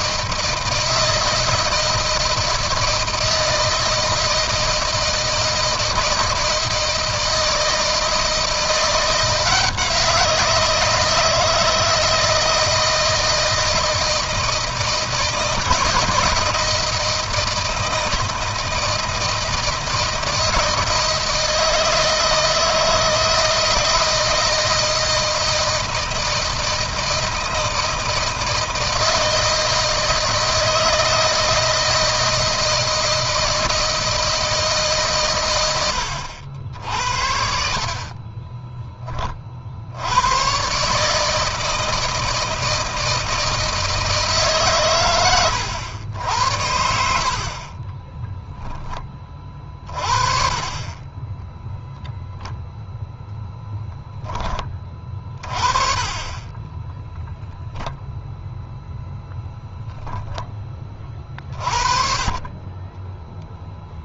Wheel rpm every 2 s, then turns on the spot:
160, 160, 160, 160, 170, 160, 160, 160, 170, 160, 160, 160, 160, 160, 160, 160, 160, 150, 70, 20, 140, 160, 120, 70, 20, 30, 0, 20, 10, 0, 30, 20.
56-58